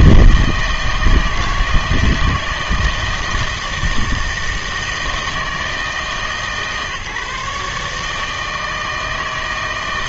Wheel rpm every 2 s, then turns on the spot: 160, 170, 160, 150, 160.
none